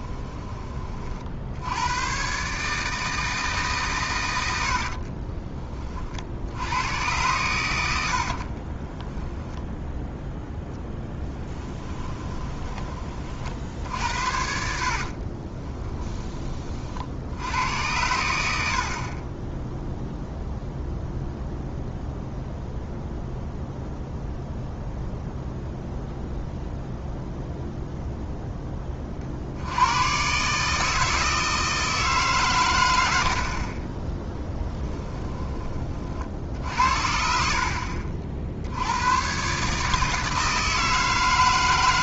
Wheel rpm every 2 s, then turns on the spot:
30, 150, 70, 90, 30, 0, 20, 60, 40, 60, 0, 0, 0, 0, 10, 150, 110, 10, 60, 80, 160.
4-6 8-10 14-16 34-36